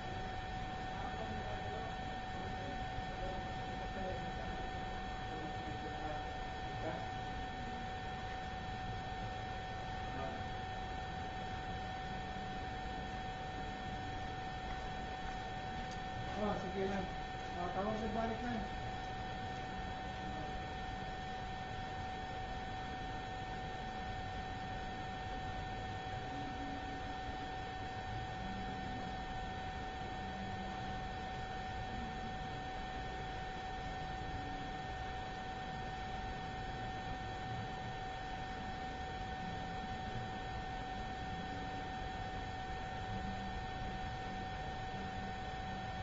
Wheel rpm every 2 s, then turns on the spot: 0, 0, 0, 0, 0, 0, 0, 0, 0, 0, 0, 0, 0, 0, 0, 0, 0, 0, 0, 0, 0, 0, 0.
none